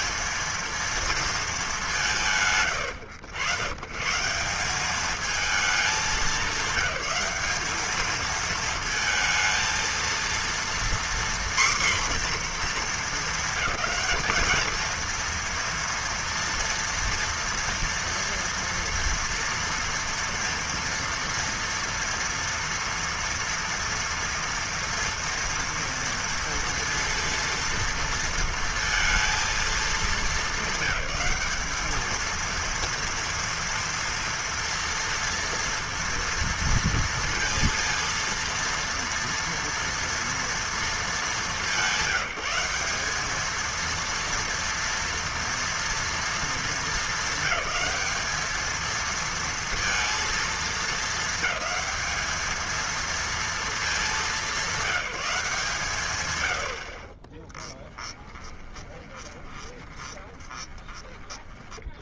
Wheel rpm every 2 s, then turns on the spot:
220, 140, 200, 210, 220, 240, 220, 220, 230, 230, 230, 230, 230, 230, 230, 210, 230, 230, 230, 230, 220, 190, 230, 230, 220, 220, 230, 190, 30, 20, 30.
58-60